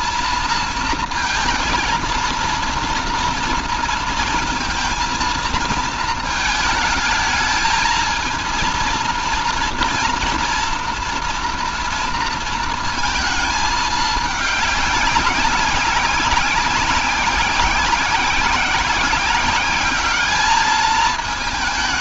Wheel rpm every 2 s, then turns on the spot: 230, 230, 230, 220, 230, 230, 230, 210, 190, 190, 210.
none